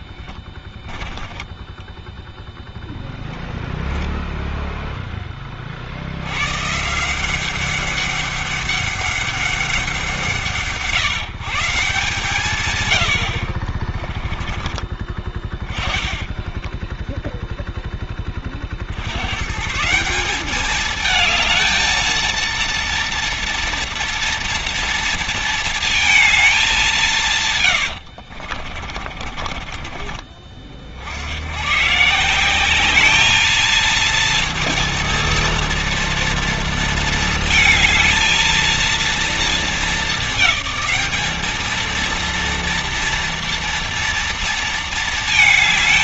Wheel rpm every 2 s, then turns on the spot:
10, 0, 0, 110, 200, 150, 140, 20, 20, 30, 200, 230, 230, 210, 60, 40, 180, 230, 230, 230, 210, 230, 230.
0-2 16-18 28-30